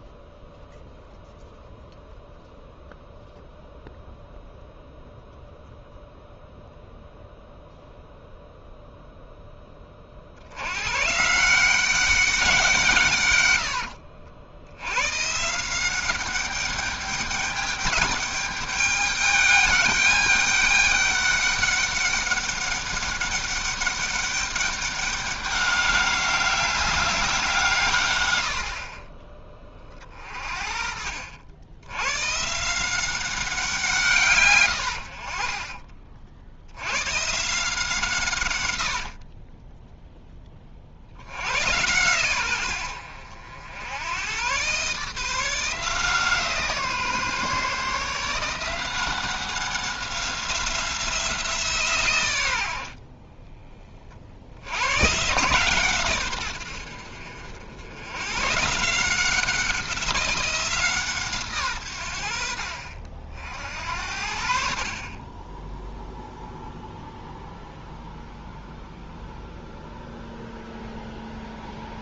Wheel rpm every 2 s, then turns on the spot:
0, 0, 0, 0, 0, 110, 170, 90, 200, 200, 200, 200, 200, 190, 50, 50, 170, 90, 90, 100, 40, 90, 130, 160, 170, 180, 70, 100, 80, 150, 170, 60, 50, 0, 0, 0.
30-32 34-36 38-40